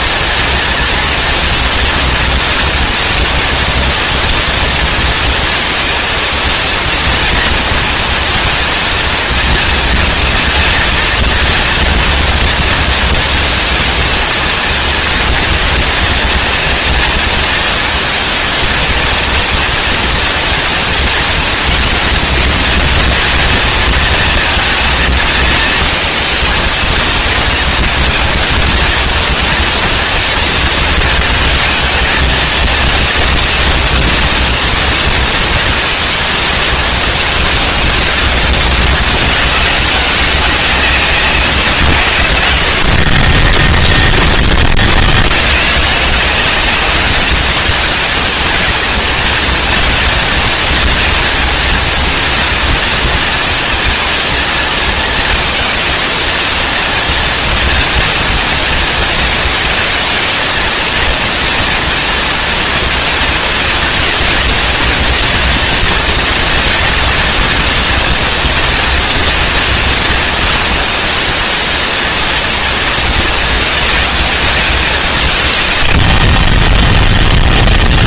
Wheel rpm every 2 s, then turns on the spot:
230, 230, 230, 230, 230, 230, 230, 230, 230, 230, 230, 230, 230, 230, 230, 230, 220, 230, 220, 210, 190, 70, 20, 180, 220, 230, 230, 230, 230, 220, 220, 230, 240, 230, 230, 230, 220, 180, 30.
76-78